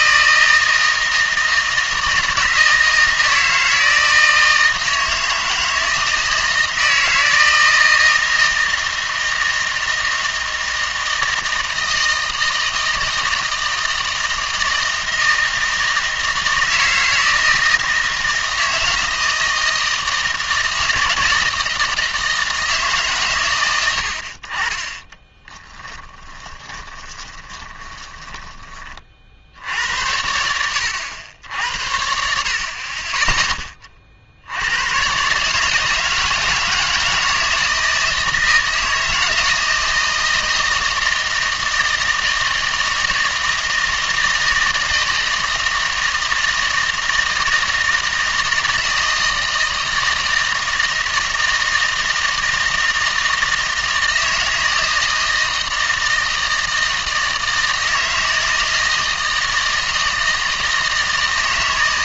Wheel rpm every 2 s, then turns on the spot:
160, 160, 160, 160, 160, 160, 160, 160, 160, 160, 160, 160, 40, 10, 20, 80, 50, 80, 160, 160, 160, 160, 160, 160, 160, 160, 160, 160, 160, 160, 160.
26-28